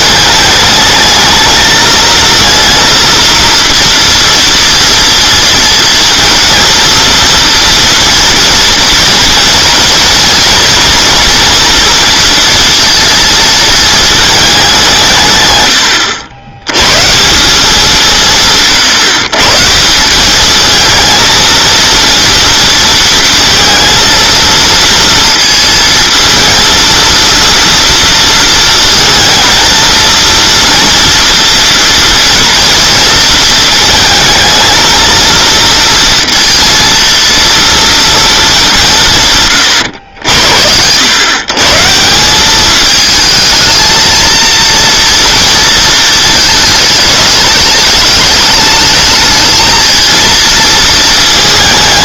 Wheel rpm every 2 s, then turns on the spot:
210, 230, 230, 230, 240, 230, 230, 190, 110, 160, 220, 230, 230, 230, 230, 230, 230, 230, 230, 180, 90, 210, 230, 210, 210, 220.
none